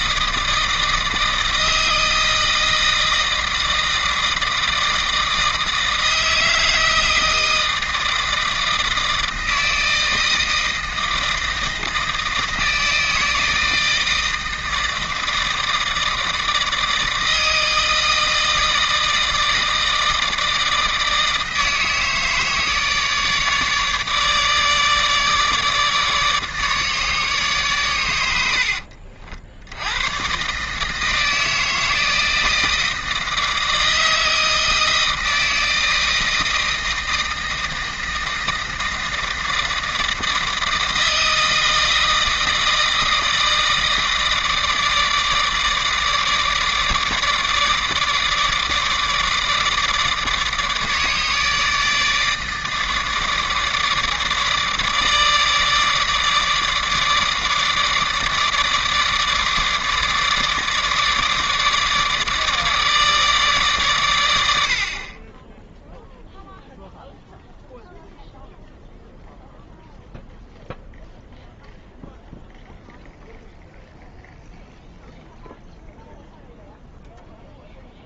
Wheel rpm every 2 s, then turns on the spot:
160, 160, 160, 160, 160, 160, 160, 160, 160, 160, 160, 150, 150, 150, 60, 150, 160, 160, 160, 160, 160, 160, 160, 150, 160, 160, 160, 150, 150, 160, 150, 160, 60, 0, 0, 0, 0, 0, 0.
28-30